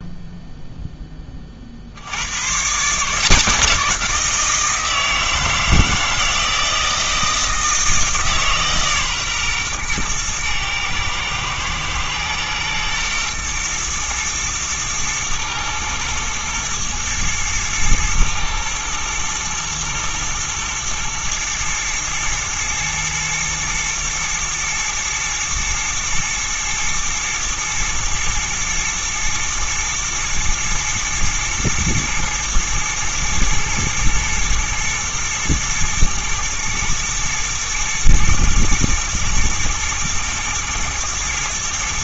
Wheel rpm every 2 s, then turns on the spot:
0, 140, 170, 160, 140, 110, 120, 110, 110, 110, 120, 110, 120, 110, 110, 110, 110, 110, 110, 110, 120.
none